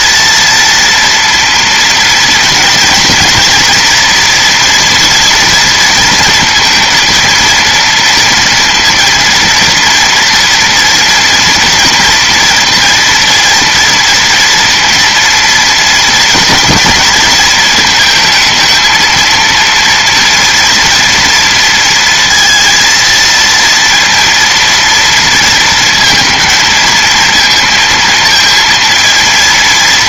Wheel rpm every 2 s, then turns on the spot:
230, 230, 230, 230, 230, 230, 230, 230, 230, 220, 230, 230, 230, 230, 220.
none